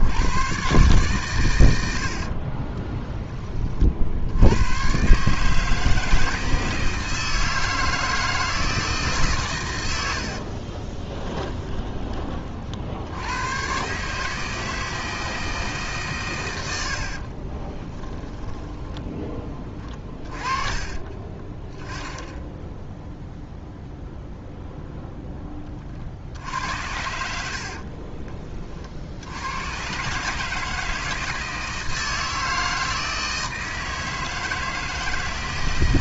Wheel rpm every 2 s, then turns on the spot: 120, 30, 110, 160, 160, 30, 50, 160, 90, 10, 40, 0, 0, 70, 40, 160, 160, 160.
2-4 10-12